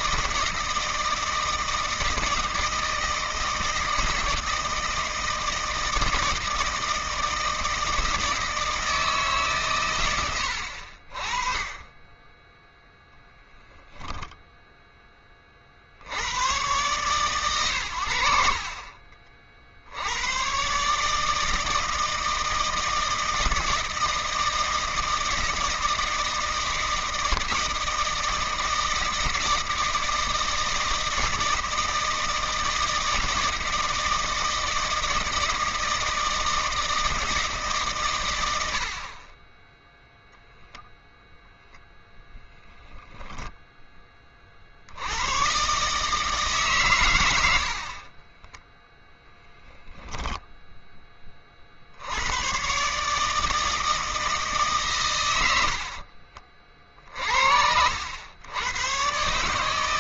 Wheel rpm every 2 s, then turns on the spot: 160, 160, 160, 160, 160, 70, 10, 10, 110, 50, 130, 160, 160, 160, 160, 160, 160, 160, 160, 70, 0, 0, 60, 140, 10, 10, 130, 150, 50, 110.
48-50